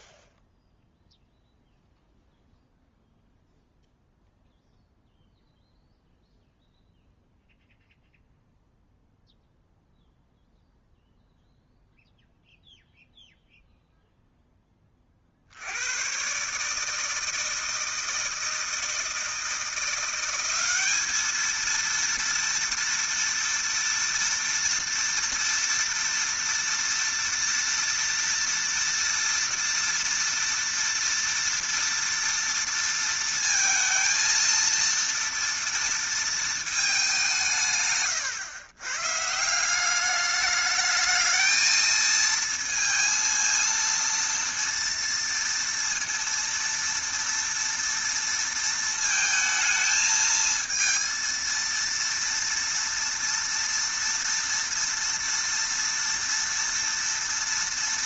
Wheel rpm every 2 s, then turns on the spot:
0, 0, 0, 0, 0, 0, 0, 10, 140, 160, 190, 230, 230, 230, 230, 230, 230, 230, 220, 120, 210, 230, 230, 230, 230, 220, 230, 230, 230.
none